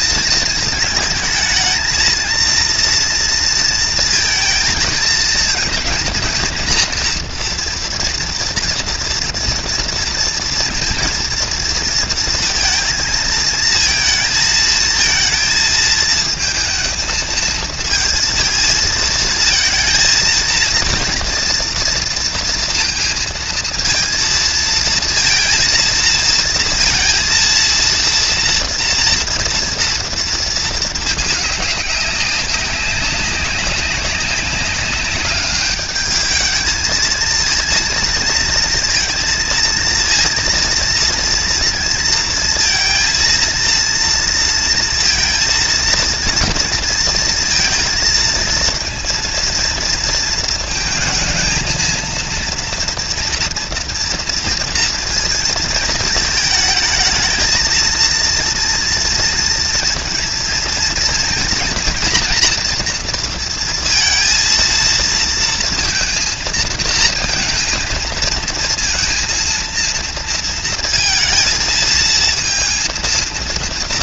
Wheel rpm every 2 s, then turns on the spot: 220, 230, 220, 230, 230, 230, 230, 220, 220, 230, 230, 220, 230, 230, 230, 220, 200, 200, 220, 230, 230, 230, 230, 230, 230, 220, 230, 230, 220, 230, 230, 230, 230, 220, 230, 230, 230.
none